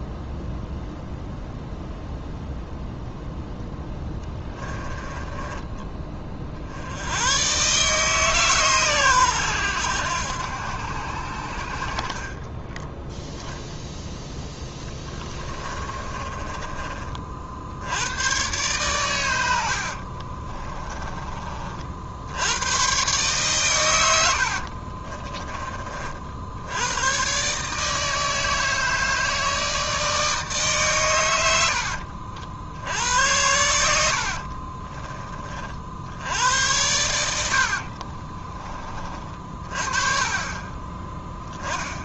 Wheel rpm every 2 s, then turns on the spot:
0, 0, 20, 60, 140, 80, 20, 20, 30, 120, 30, 110, 60, 80, 160, 150, 70, 40, 90, 30, 20.
4-6 12-18 20-22 24-26 34-36